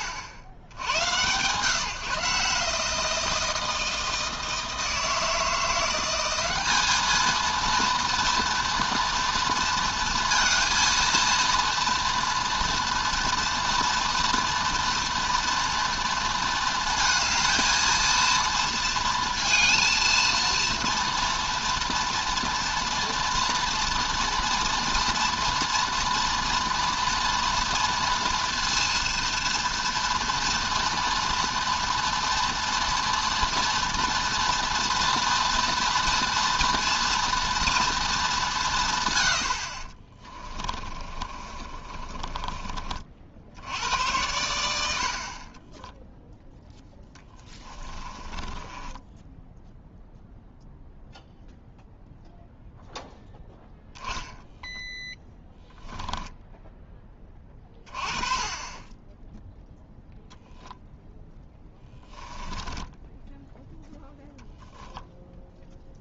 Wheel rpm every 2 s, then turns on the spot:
100, 160, 160, 210, 230, 230, 230, 230, 230, 230, 230, 230, 230, 230, 230, 230, 240, 230, 230, 150, 30, 40, 70, 10, 10, 0, 0, 10, 10, 20, 10, 20, 10.
40-42 46-50 54-56 62-64